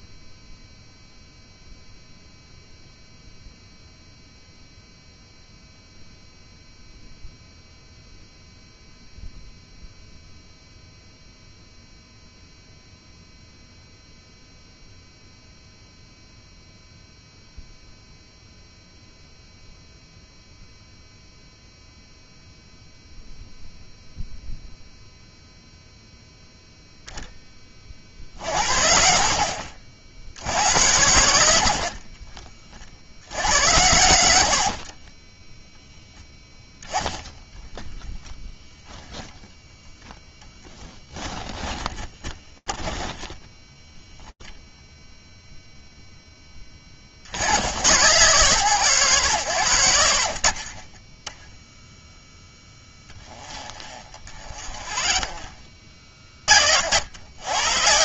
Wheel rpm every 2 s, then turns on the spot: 0, 0, 0, 0, 0, 0, 0, 0, 0, 0, 0, 0, 0, 0, 60, 80, 40, 50, 10, 0, 20, 10, 0, 50, 90, 10, 20, 40, 90.
34-38 40-44 52-56